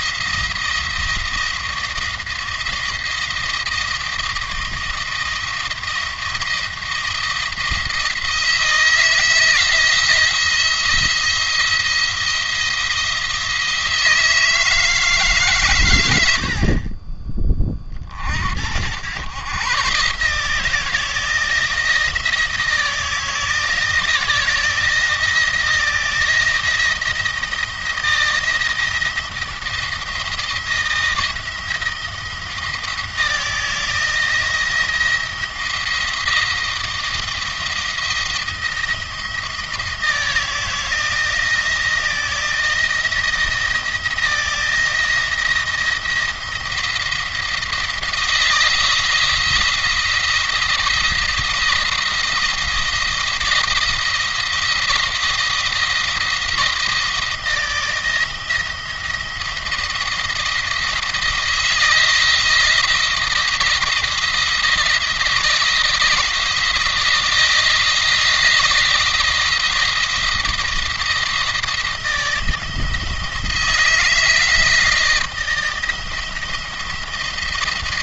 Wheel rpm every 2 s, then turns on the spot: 170, 170, 170, 170, 170, 170, 170, 160, 40, 90, 160, 160, 160, 170, 170, 170, 170, 160, 170, 170, 160, 160, 170, 170, 170, 170, 170, 170, 170, 170, 170, 170, 170, 170, 170, 170, 170, 170, 170.
none